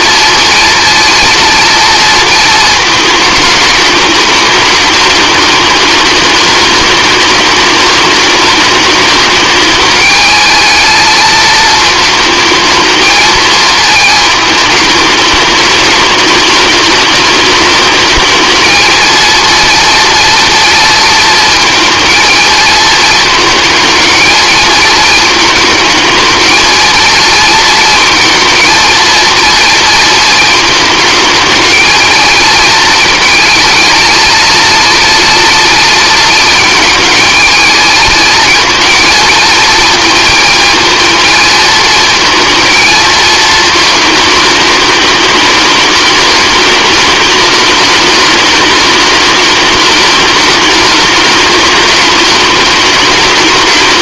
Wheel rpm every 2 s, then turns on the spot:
230, 220, 220, 210, 210, 220, 220, 210, 210, 220, 230, 230, 220, 230, 230, 220, 230, 230, 220, 230, 230, 230, 210, 210, 210, 210, 200.
none